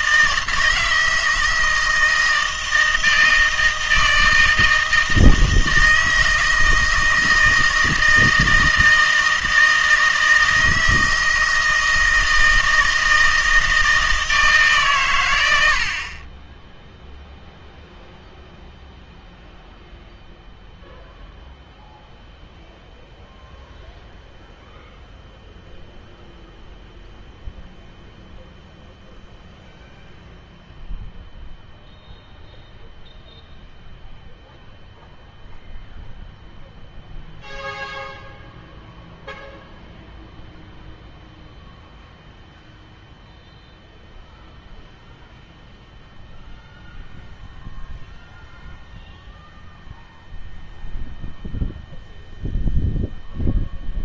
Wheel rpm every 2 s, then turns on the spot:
160, 160, 160, 160, 160, 160, 160, 150, 10, 0, 0, 0, 0, 0, 0, 0, 0, 0, 0, 0, 0, 0, 0, 0, 0, 0, 0.
none